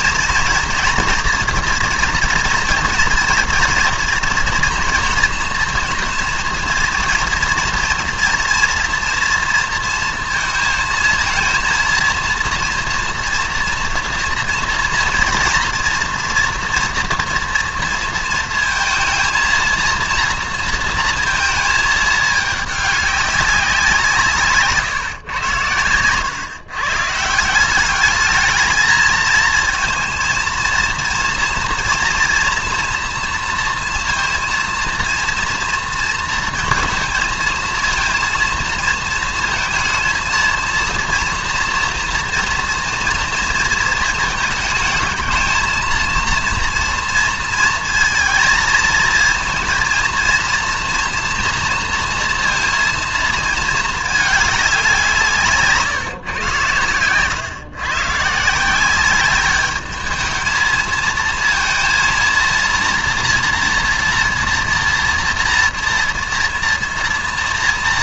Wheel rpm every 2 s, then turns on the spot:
230, 230, 230, 230, 230, 230, 230, 230, 230, 230, 230, 210, 140, 130, 210, 230, 230, 230, 230, 230, 230, 230, 220, 230, 220, 230, 230, 200, 110, 170, 220, 230, 230, 230.
none